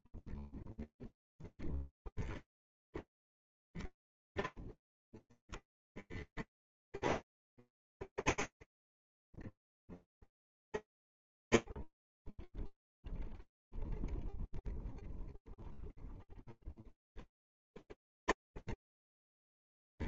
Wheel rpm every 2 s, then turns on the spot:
0, 0, 0, 10, 20, 30, 0, 0, 0, 10.
8-10